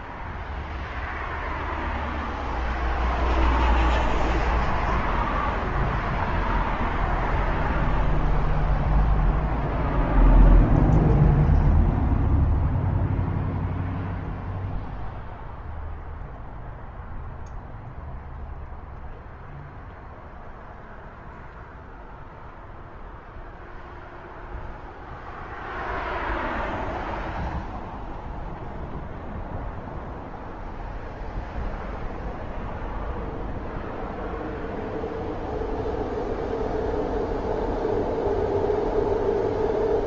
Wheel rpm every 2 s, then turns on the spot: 0, 0, 0, 0, 0, 0, 0, 0, 0, 0, 0, 0, 0, 0, 0, 0, 0, 0, 0, 0.
none